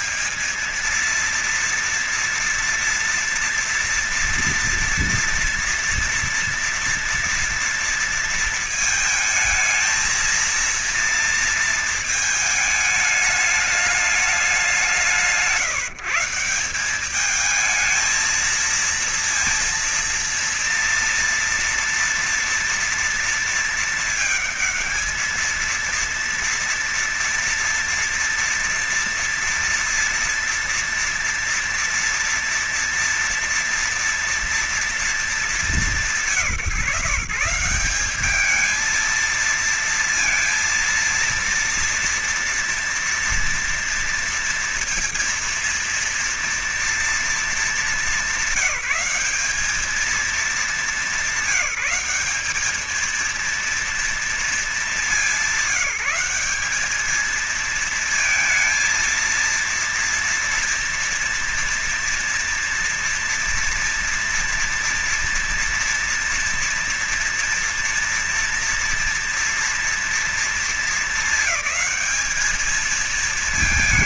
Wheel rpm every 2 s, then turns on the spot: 220, 230, 230, 230, 230, 230, 220, 210, 170, 220, 230, 230, 230, 230, 230, 230, 230, 240, 190, 200, 230, 230, 230, 230, 200, 210, 200, 230, 190, 220, 230, 240, 230, 230, 230, 230, 220.
none